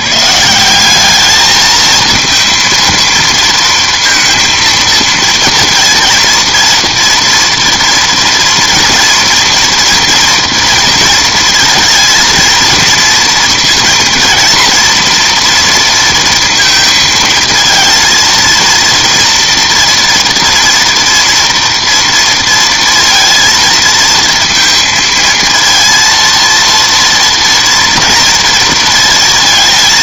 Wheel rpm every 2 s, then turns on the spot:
190, 230, 230, 230, 230, 230, 230, 230, 230, 230, 230, 230, 220, 230, 230.
none